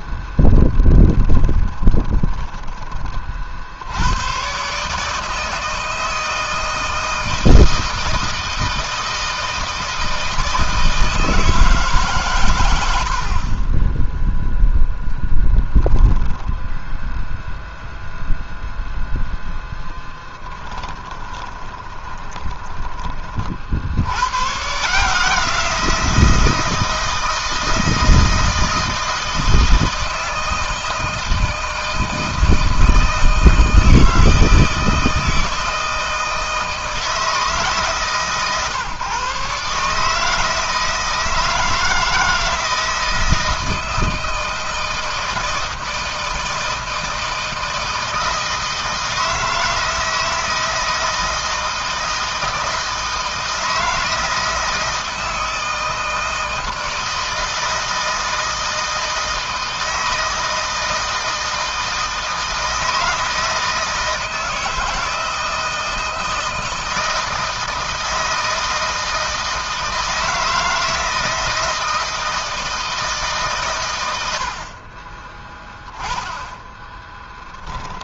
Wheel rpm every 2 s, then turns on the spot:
10, 30, 140, 160, 160, 160, 70, 0, 0, 0, 20, 20, 140, 160, 160, 160, 160, 160, 160, 140, 160, 160, 160, 160, 160, 160, 160, 160, 160, 160, 160, 160, 160, 160, 160, 160, 160, 40, 10.
0-2 12-14 20-22 74-76